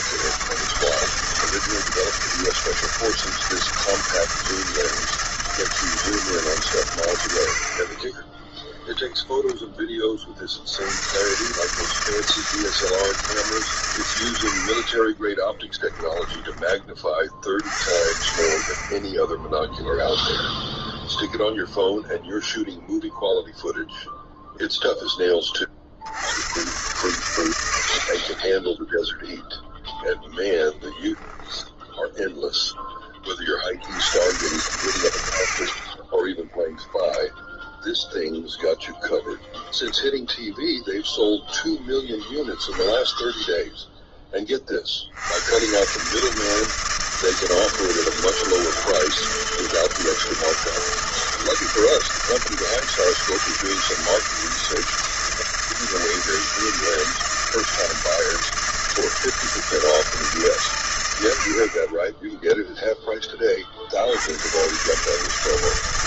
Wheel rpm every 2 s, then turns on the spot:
140, 160, 160, 130, 0, 60, 160, 70, 20, 30, 0, 0, 0, 100, 20, 0, 0, 90, 10, 0, 0, 0, 40, 160, 160, 160, 160, 160, 160, 160, 150, 10, 110.
none